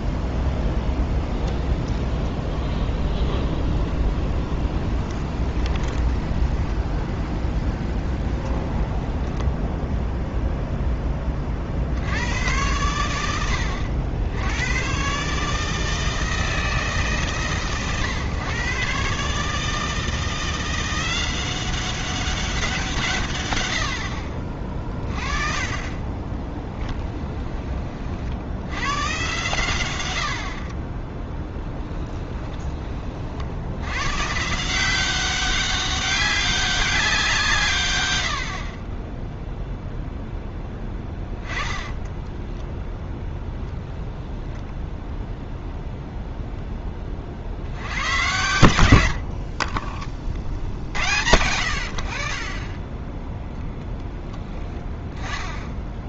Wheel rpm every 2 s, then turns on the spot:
0, 0, 10, 20, 20, 0, 110, 90, 160, 120, 170, 190, 40, 10, 80, 50, 20, 160, 200, 60, 10, 10, 10, 0, 100, 60, 30, 10.
4-10 26-28 30-32 40-42